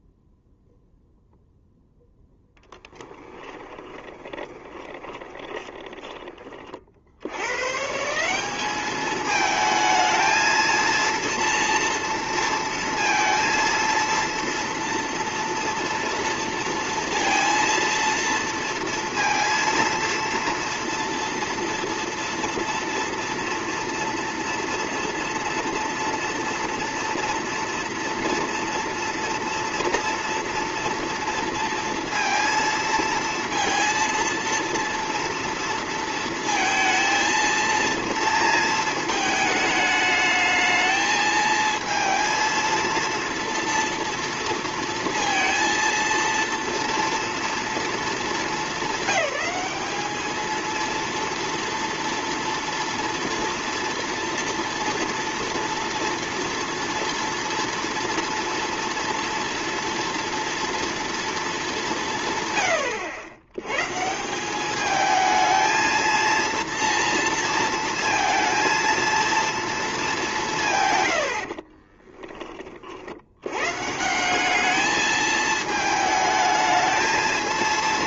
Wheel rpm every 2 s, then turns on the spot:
0, 10, 20, 30, 200, 230, 230, 230, 230, 230, 230, 230, 230, 230, 230, 240, 230, 230, 230, 230, 220, 230, 230, 230, 220, 230, 230, 230, 230, 230, 230, 120, 200, 230, 230, 150, 30, 200, 220.
2-6